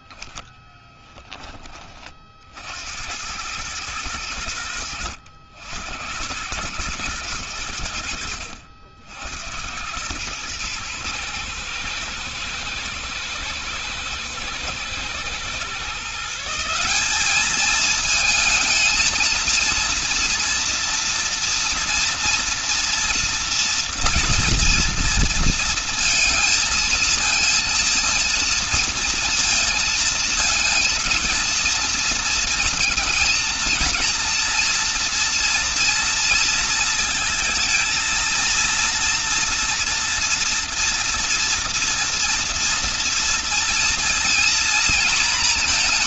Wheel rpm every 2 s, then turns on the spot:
0, 60, 80, 100, 70, 120, 120, 120, 180, 220, 230, 230, 230, 220, 230, 230, 230, 240, 230, 230, 230, 230, 230.
none